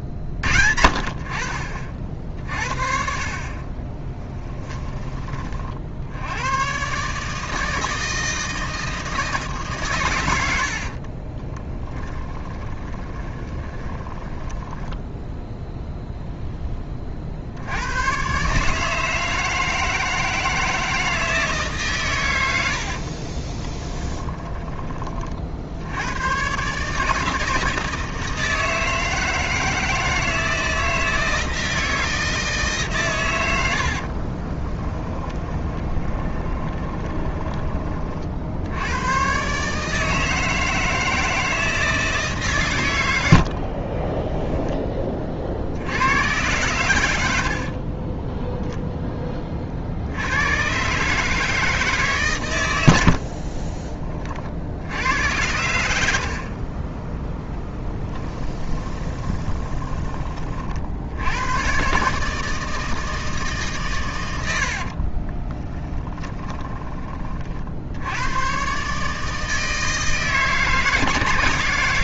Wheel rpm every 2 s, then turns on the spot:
50, 50, 10, 120, 160, 70, 30, 10, 10, 150, 160, 70, 30, 140, 160, 160, 150, 10, 10, 80, 160, 120, 20, 100, 0, 110, 100, 60, 30, 20, 50, 160, 60, 20, 130, 160.
4-6 10-16 24-26 34-38 56-60 64-68